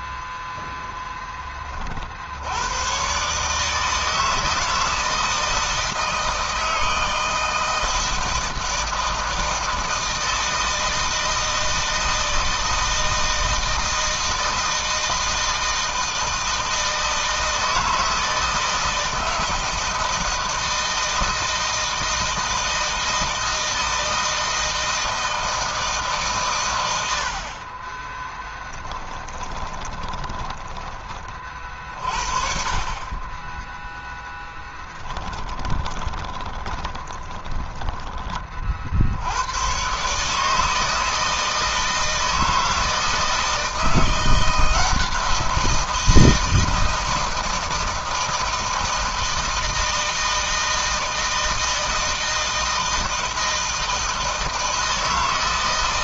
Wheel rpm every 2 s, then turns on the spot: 0, 80, 160, 160, 160, 160, 160, 160, 160, 160, 160, 160, 160, 130, 30, 20, 40, 10, 20, 30, 150, 160, 170, 170, 160, 160, 160, 160.
28-32 34-38